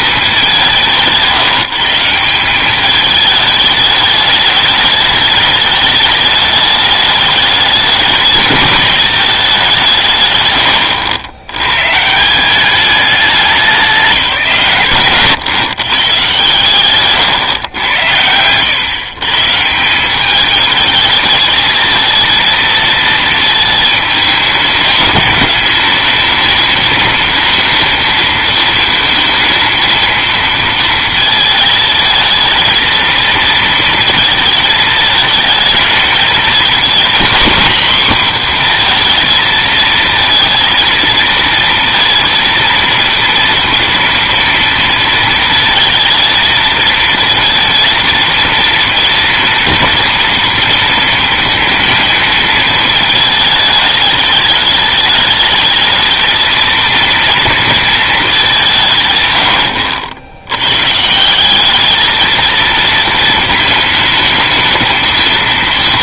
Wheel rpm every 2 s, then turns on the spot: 180, 200, 210, 210, 210, 120, 190, 140, 140, 110, 210, 230, 210, 220, 230, 230, 220, 220, 230, 250, 230, 230, 230, 220, 230, 230, 220, 210, 230, 190, 90, 220, 220.
none